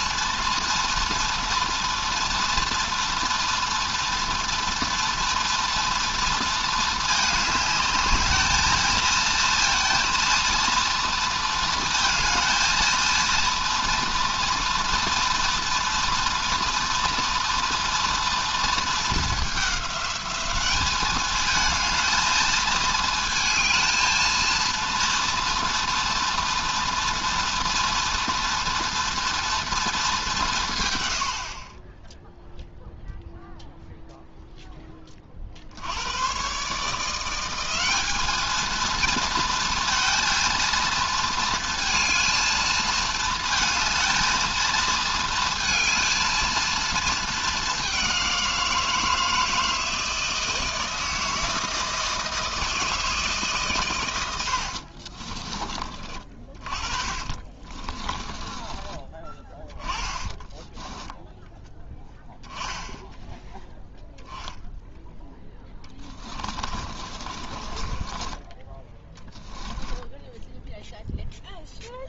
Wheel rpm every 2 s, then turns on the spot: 230, 230, 230, 230, 220, 230, 230, 230, 230, 220, 200, 220, 230, 230, 230, 140, 0, 10, 140, 220, 230, 220, 220, 220, 170, 160, 160, 70, 30, 20, 10, 10, 0, 20, 10, 0.
54-58 60-62 66-68